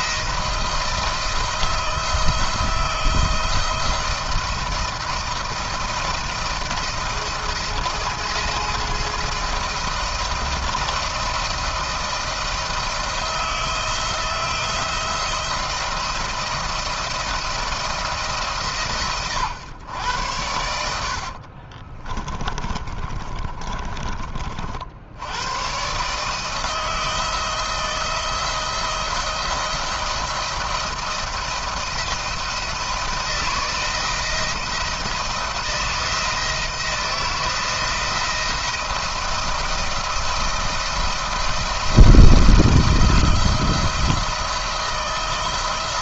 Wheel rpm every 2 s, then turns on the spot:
170, 170, 170, 170, 170, 170, 170, 170, 170, 160, 90, 20, 50, 160, 170, 170, 170, 160, 170, 170, 170, 170, 170.
20-24